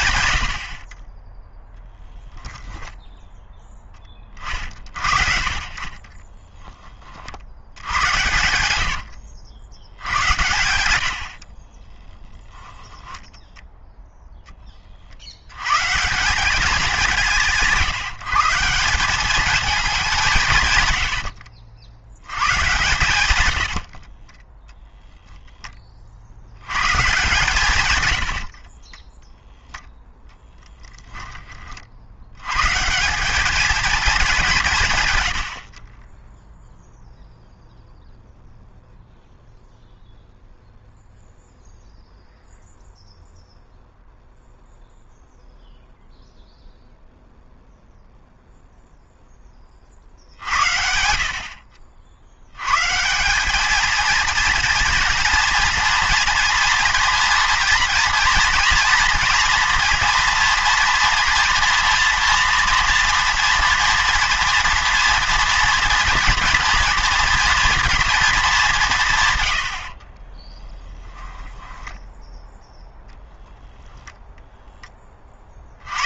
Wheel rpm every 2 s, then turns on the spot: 50, 10, 50, 10, 90, 90, 10, 30, 190, 170, 140, 130, 10, 110, 40, 10, 130, 170, 0, 0, 0, 0, 0, 0, 0, 70, 110, 230, 230, 240, 230, 240, 230, 230, 200, 10, 0, 10.
12-14 24-26 28-30 70-72